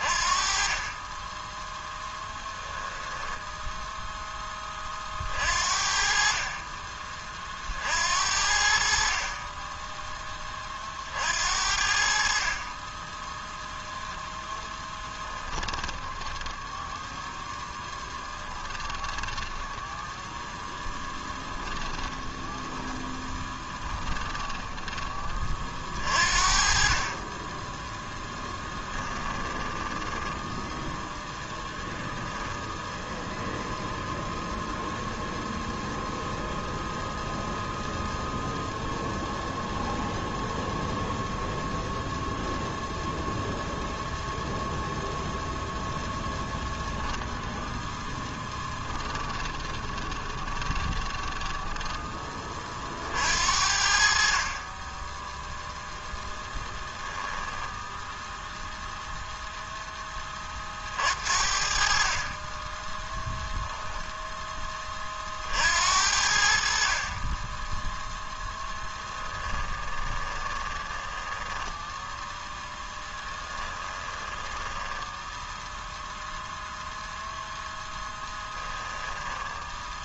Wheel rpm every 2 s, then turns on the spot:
20, 10, 30, 30, 50, 40, 20, 20, 10, 20, 0, 10, 20, 30, 10, 0, 0, 0, 0, 0, 0, 0, 0, 0, 10, 10, 40, 20, 10, 0, 60, 10, 20, 50, 10, 10, 10, 10, 0, 10.
14-16 18-20 22-24 28-30 48-52 56-58 68-76 78-80